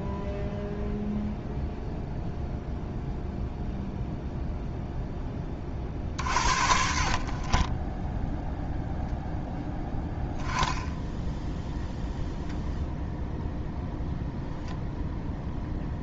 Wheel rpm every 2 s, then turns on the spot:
0, 0, 0, 60, 0, 10, 0, 0.
none